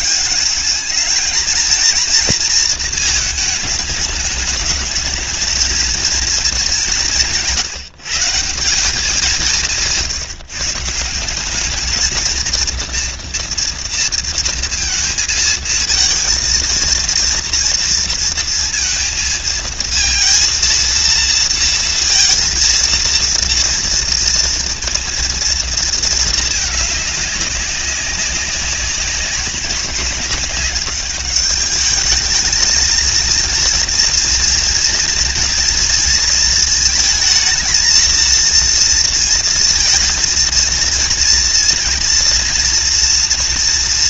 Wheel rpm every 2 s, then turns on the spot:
210, 220, 220, 180, 190, 170, 230, 230, 230, 230, 230, 230, 230, 210, 190, 210, 230, 240, 220, 230, 230, 240.
none